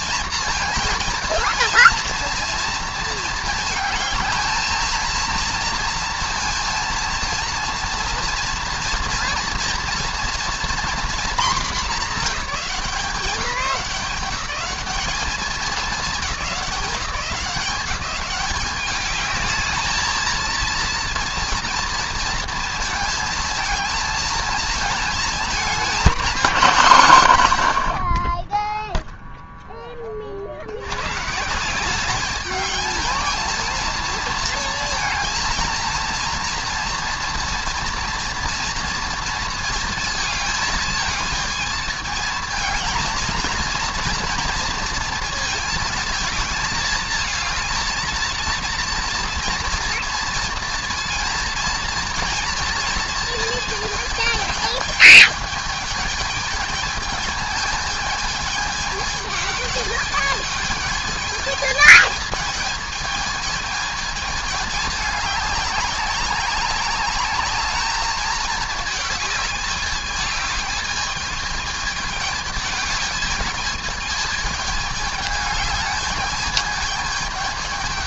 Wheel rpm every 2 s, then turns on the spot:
230, 230, 220, 230, 230, 240, 200, 190, 210, 200, 230, 230, 220, 210, 30, 60, 210, 230, 230, 230, 230, 220, 230, 220, 230, 230, 230, 220, 220, 220, 210, 220, 220, 190, 210, 210, 210, 210, 210.
none